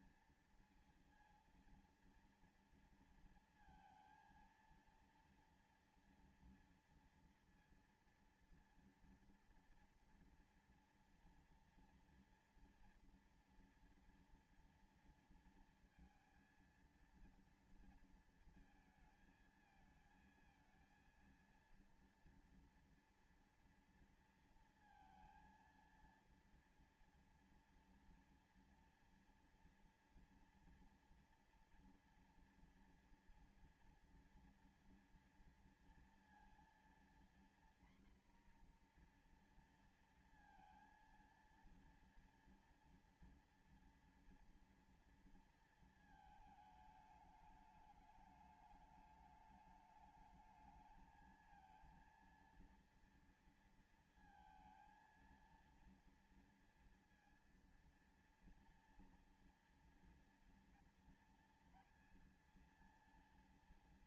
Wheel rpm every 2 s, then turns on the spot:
230, 230, 230, 230, 230, 230, 230, 230, 230, 220, 230, 230, 230, 230, 230, 240, 240, 230, 240, 240, 230, 240, 240, 220, 210, 220, 230, 230, 230, 230, 230, 230.
none